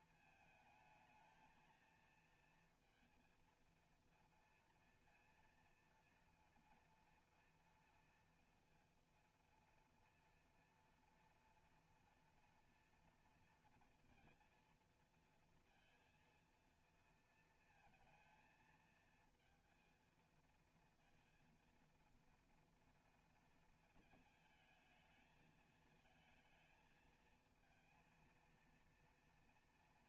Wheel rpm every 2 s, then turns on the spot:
220, 230, 230, 230, 230, 230, 230, 230, 230, 230, 230, 230, 220, 220, 230.
none